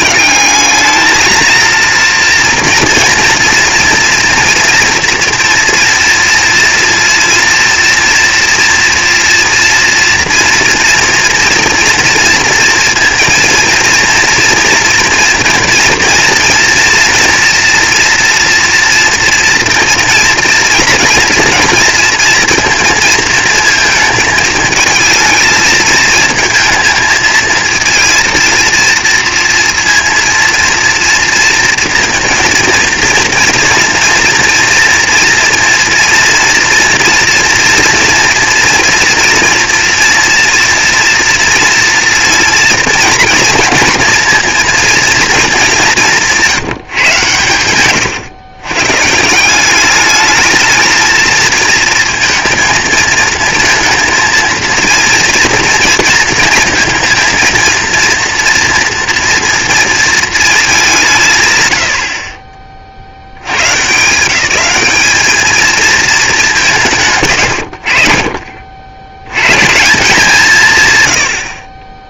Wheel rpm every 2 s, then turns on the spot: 200, 230, 240, 230, 230, 230, 230, 230, 230, 230, 240, 230, 220, 220, 230, 230, 230, 230, 240, 230, 230, 230, 230, 170, 120, 220, 230, 230, 220, 230, 210, 20, 190, 180, 60, 200.
none